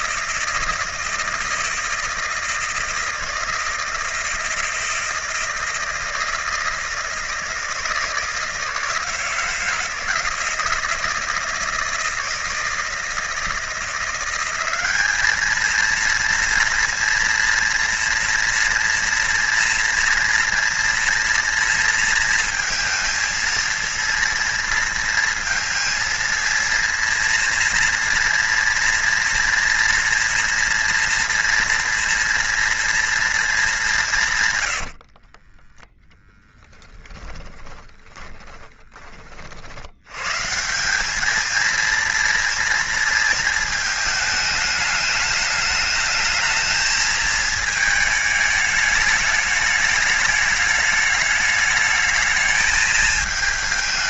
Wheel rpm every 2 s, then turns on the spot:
160, 160, 160, 160, 160, 160, 160, 190, 230, 240, 230, 230, 230, 230, 230, 230, 230, 100, 10, 30, 180, 230, 220, 220, 210, 210, 220.
34-40